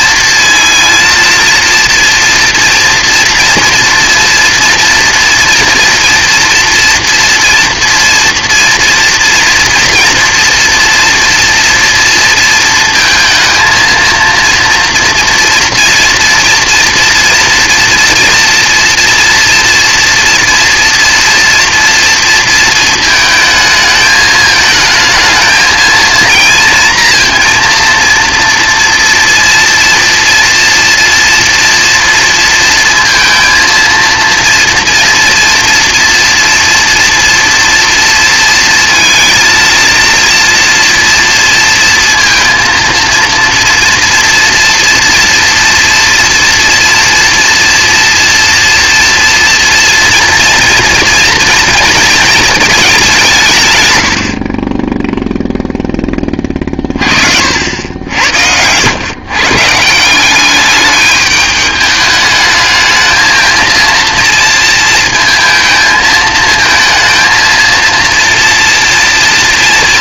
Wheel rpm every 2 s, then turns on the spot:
230, 230, 230, 230, 230, 230, 230, 230, 230, 240, 230, 230, 220, 230, 230, 230, 230, 230, 230, 230, 230, 230, 230, 240, 240, 230, 210, 30, 30, 100, 200, 220, 230, 220, 230.
none